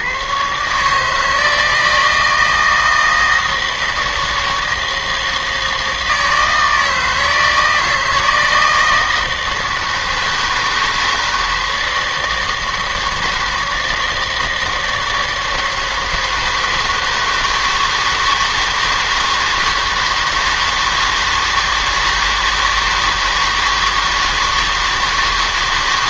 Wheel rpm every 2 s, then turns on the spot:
130, 160, 160, 160, 160, 160, 160, 160, 160, 160, 160, 160, 160.
none